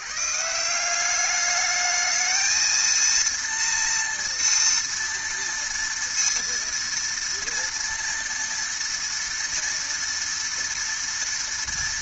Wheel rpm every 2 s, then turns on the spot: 150, 220, 230, 230, 230, 230.
none